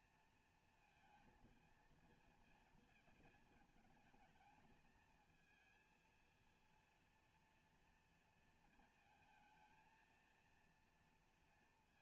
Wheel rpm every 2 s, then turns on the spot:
230, 230, 220, 230, 240, 230.
none